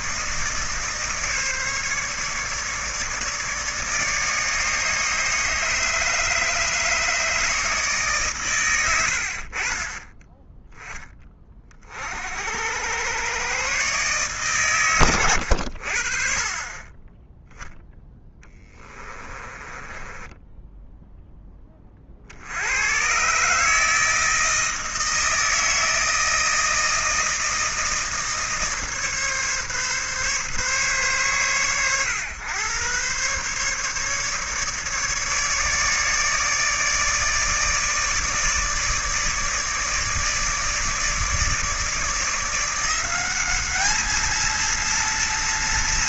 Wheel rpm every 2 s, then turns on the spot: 150, 150, 150, 150, 110, 10, 80, 120, 30, 10, 10, 90, 160, 160, 150, 130, 110, 150, 150, 150, 160, 170, 230.
18-22